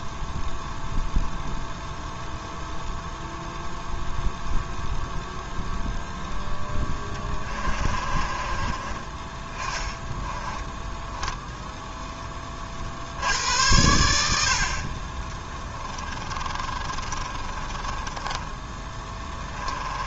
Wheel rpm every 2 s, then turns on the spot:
0, 0, 0, 10, 30, 10, 60, 30, 30, 10.
6-8 10-12 16-18